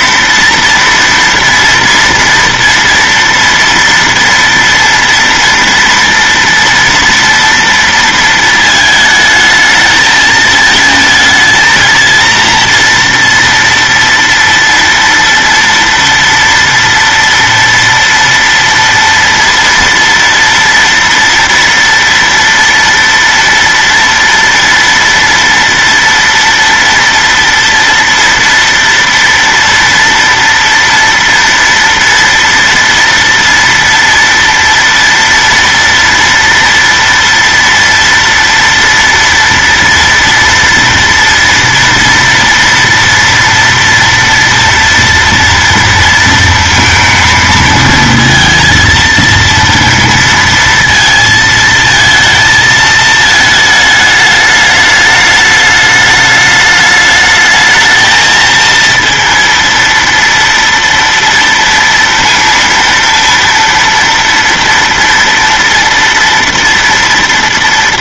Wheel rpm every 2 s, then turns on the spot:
230, 230, 230, 230, 220, 220, 230, 230, 230, 230, 230, 240, 230, 230, 230, 230, 230, 240, 230, 230, 230, 230, 230, 230, 230, 230, 220, 210, 210, 230, 230, 230, 230, 230.
none